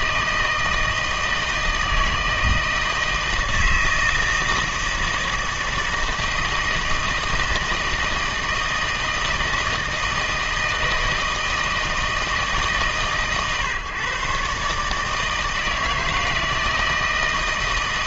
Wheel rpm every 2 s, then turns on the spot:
160, 160, 160, 160, 160, 160, 150, 140, 160.
none